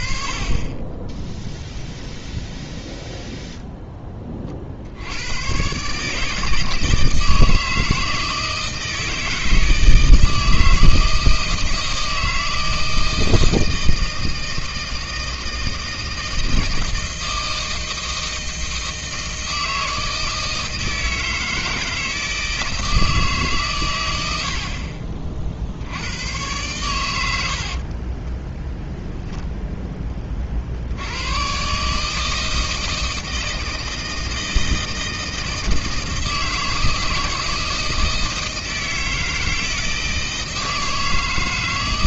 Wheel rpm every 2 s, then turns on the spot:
20, 0, 70, 160, 160, 160, 160, 160, 160, 160, 160, 160, 50, 110, 10, 50, 160, 160, 160, 160, 160.
24-26 28-30